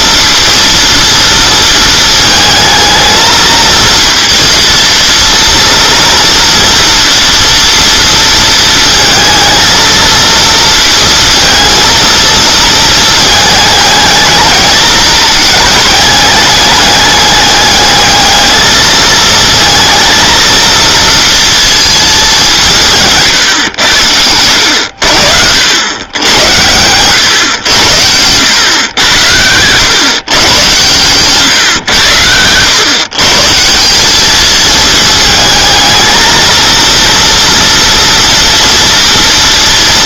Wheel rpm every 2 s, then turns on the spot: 230, 220, 230, 230, 230, 230, 220, 220, 210, 220, 230, 170, 80, 110, 100, 120, 120, 220, 230, 230.
none